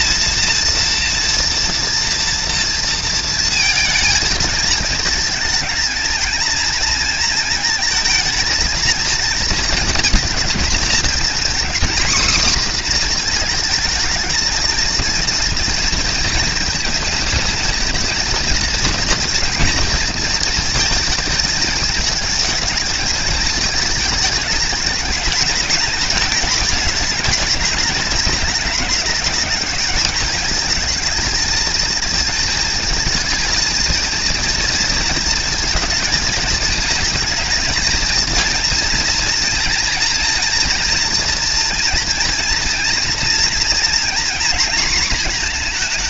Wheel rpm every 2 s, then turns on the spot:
230, 230, 220, 230, 230, 230, 240, 230, 230, 230, 220, 220, 210, 210, 210, 220, 230, 230, 230, 230, 230, 240, 230.
none